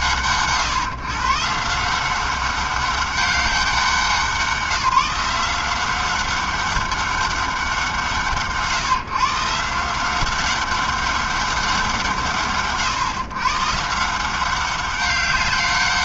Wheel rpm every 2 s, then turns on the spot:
110, 170, 190, 180, 160, 160, 180, 130.
none